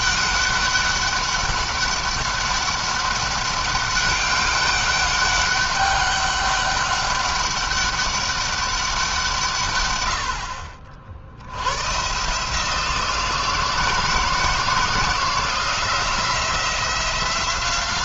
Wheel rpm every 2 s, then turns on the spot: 200, 200, 200, 200, 190, 60, 160, 170, 180.
none